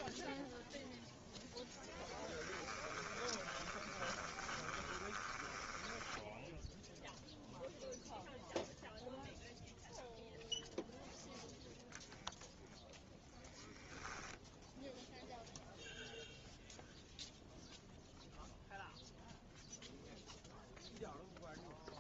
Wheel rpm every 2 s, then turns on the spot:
0, 20, 20, 0, 0, 0, 0, 0, 0, 0, 0.
2-6